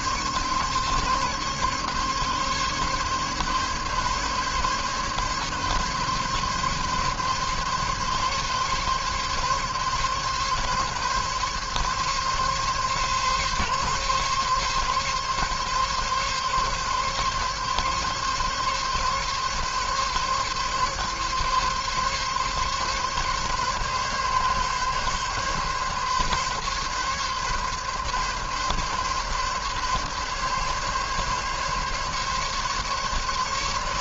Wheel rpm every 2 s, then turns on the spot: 140, 140, 140, 140, 140, 140, 140, 140, 140, 140, 140, 140, 140, 140, 140, 140, 140.
none